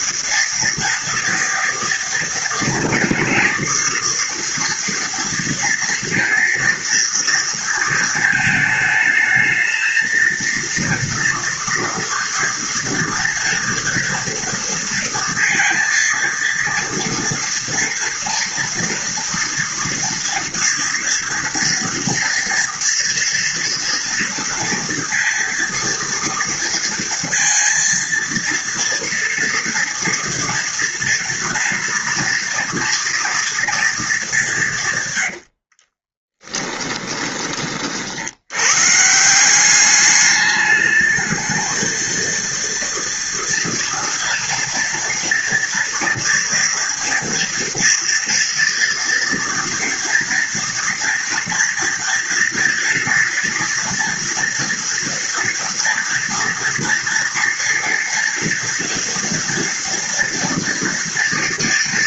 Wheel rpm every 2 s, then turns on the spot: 230, 230, 230, 230, 220, 230, 230, 230, 230, 230, 240, 230, 240, 230, 230, 240, 230, 180, 10, 110, 210, 230, 230, 230, 240, 230, 230, 240, 230, 230, 230.
36-38